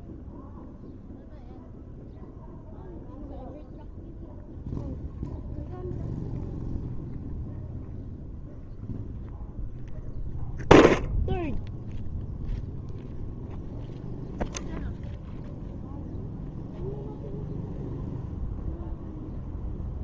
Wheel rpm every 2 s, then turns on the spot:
0, 0, 0, 0, 0, 0, 0, 0, 0, 0.
none